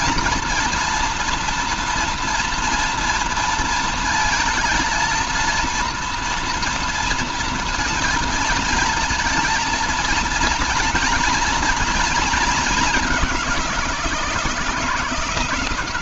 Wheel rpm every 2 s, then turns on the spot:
230, 230, 220, 230, 230, 230, 220, 160.
none